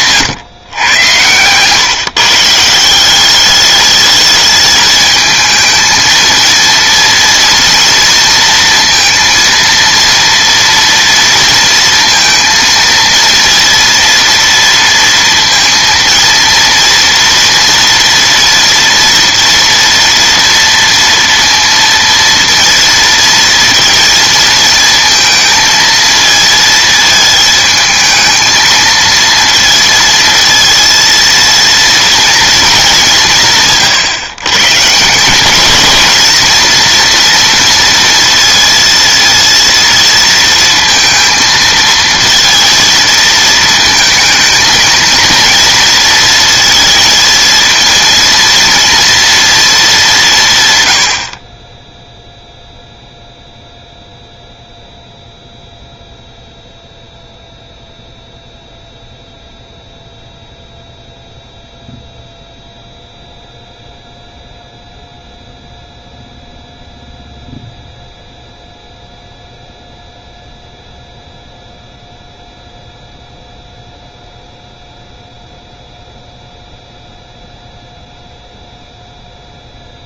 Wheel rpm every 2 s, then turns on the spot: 130, 160, 220, 230, 230, 230, 230, 230, 230, 240, 230, 230, 230, 220, 220, 230, 220, 140, 230, 230, 230, 230, 220, 230, 230, 120, 0, 0, 0, 0, 0, 0, 0, 0, 0, 0, 0, 0, 0, 0.
none